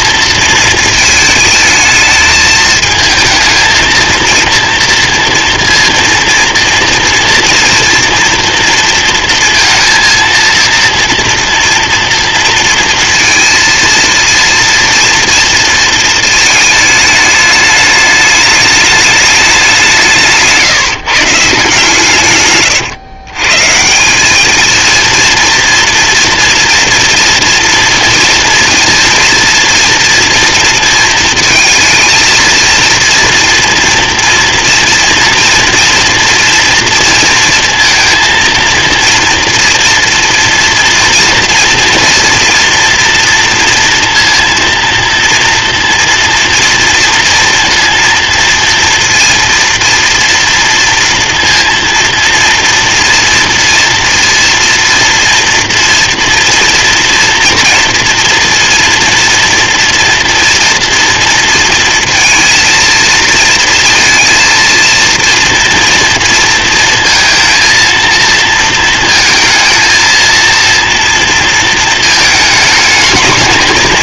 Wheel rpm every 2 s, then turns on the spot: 230, 220, 230, 230, 240, 230, 230, 230, 220, 210, 150, 130, 220, 230, 230, 230, 230, 230, 230, 230, 230, 230, 230, 230, 230, 230, 230, 230, 230, 230, 230, 230, 230, 230, 230, 230, 220.
22-24